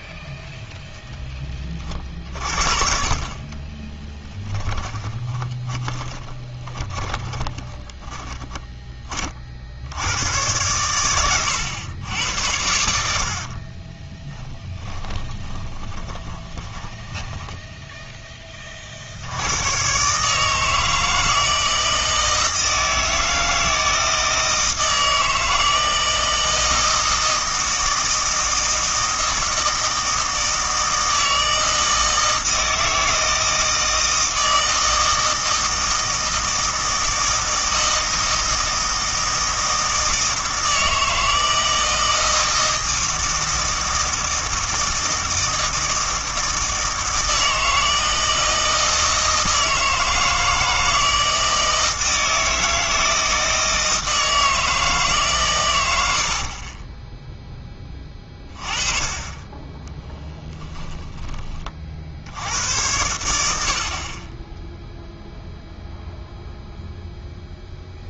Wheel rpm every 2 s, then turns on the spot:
0, 50, 10, 20, 20, 110, 70, 10, 20, 40, 160, 160, 160, 160, 160, 160, 160, 160, 160, 160, 160, 160, 160, 160, 160, 160, 160, 160, 30, 30, 10, 90, 0, 0.
4-8 14-18 56-58 60-62